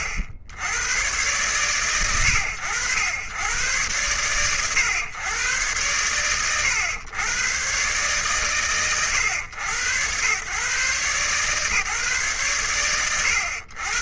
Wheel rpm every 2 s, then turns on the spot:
60, 90, 110, 100, 120, 130, 110.
none